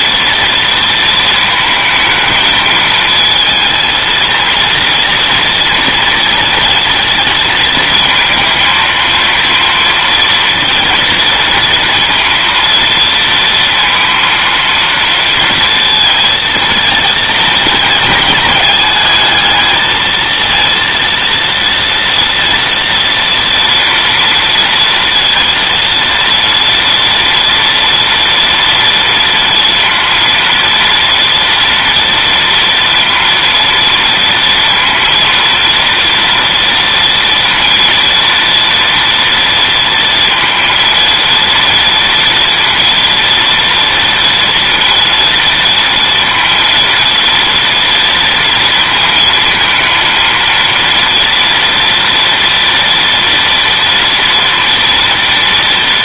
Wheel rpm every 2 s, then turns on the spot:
230, 220, 230, 230, 230, 230, 230, 230, 230, 210, 230, 230, 230, 230, 230, 230, 230, 230, 230, 230, 230, 230, 230, 230, 230, 230, 230, 230.
none